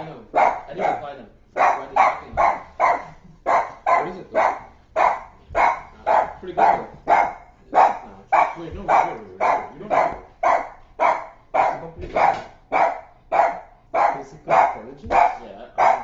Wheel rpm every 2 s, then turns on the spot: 0, 0, 0, 0, 0, 0, 0, 0.
none